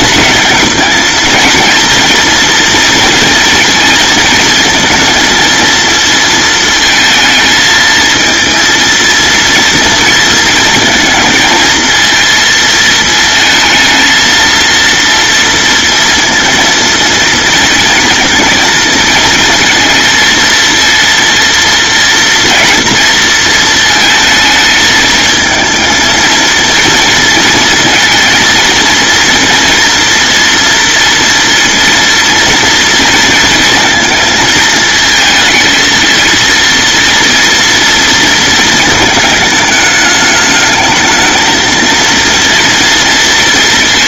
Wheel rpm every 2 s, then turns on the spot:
220, 230, 230, 220, 230, 220, 220, 230, 230, 230, 230, 230, 220, 230, 230, 230, 230, 220, 230, 220, 220, 230.
none